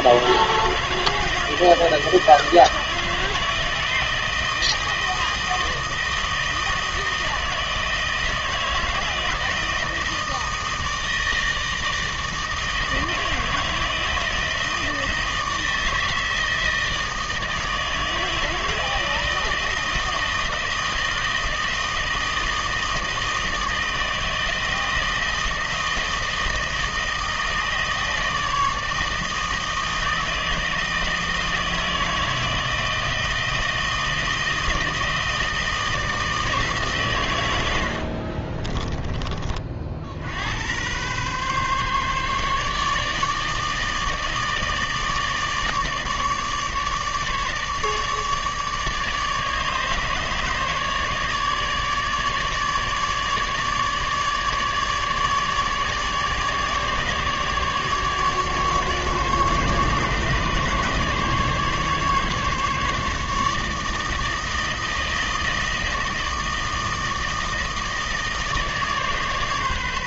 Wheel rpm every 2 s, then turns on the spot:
160, 160, 160, 160, 160, 160, 160, 160, 160, 160, 160, 160, 160, 160, 160, 160, 160, 160, 150, 30, 80, 150, 160, 150, 150, 150, 150, 150, 150, 150, 140, 150, 160, 160, 160.
38-40